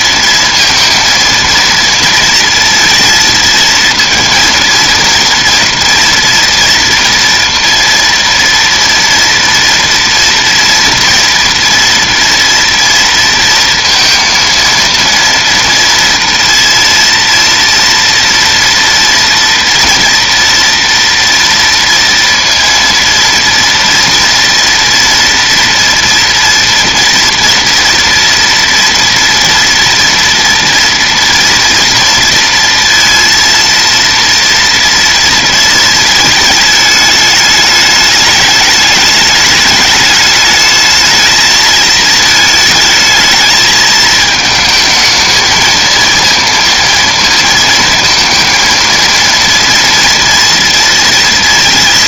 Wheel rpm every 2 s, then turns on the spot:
230, 230, 230, 230, 230, 230, 230, 230, 230, 230, 230, 230, 230, 230, 230, 230, 230, 230, 220, 210, 210, 220, 220, 230, 230, 230.
none